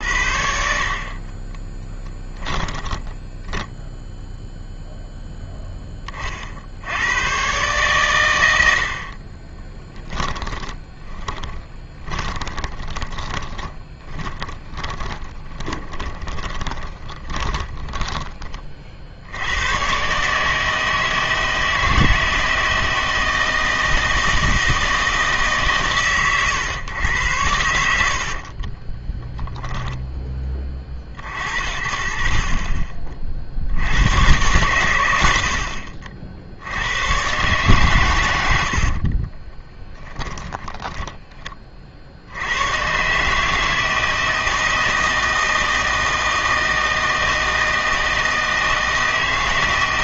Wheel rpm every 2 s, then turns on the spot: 60, 10, 0, 50, 90, 20, 20, 20, 20, 30, 160, 160, 160, 120, 50, 30, 40, 110, 70, 80, 10, 100, 160, 160, 160.
2-4 10-18 28-30 40-42